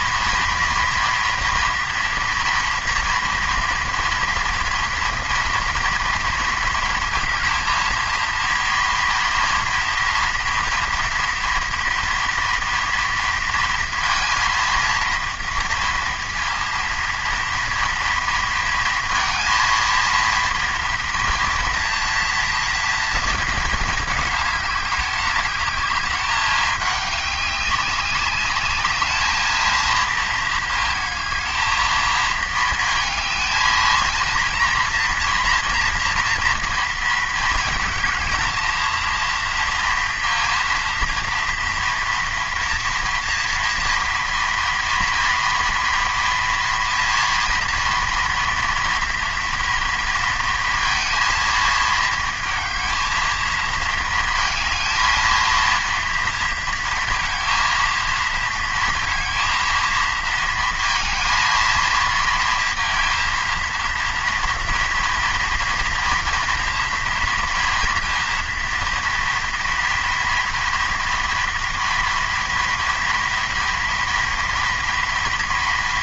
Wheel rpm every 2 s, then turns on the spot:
230, 240, 230, 230, 230, 230, 230, 230, 230, 230, 230, 230, 210, 200, 200, 220, 220, 230, 230, 220, 230, 230, 230, 230, 230, 230, 220, 220, 230, 220, 230, 230, 230, 230, 230, 230, 230, 230.
none